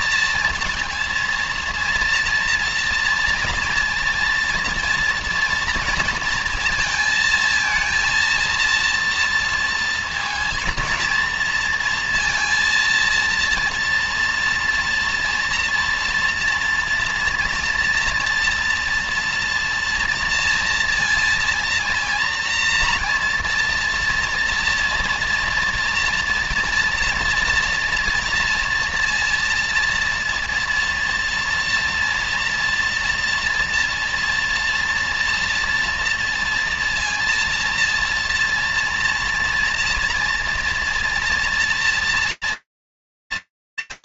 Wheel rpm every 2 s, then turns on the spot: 230, 240, 230, 230, 230, 230, 230, 240, 230, 230, 230, 230, 230, 230, 230, 230, 240, 230, 230, 230, 230, 220.
none